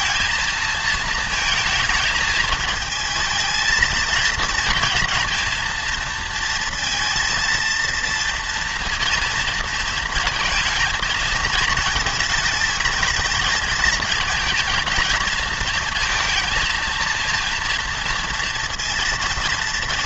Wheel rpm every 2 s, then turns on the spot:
220, 220, 230, 230, 230, 230, 220, 230, 230, 230.
none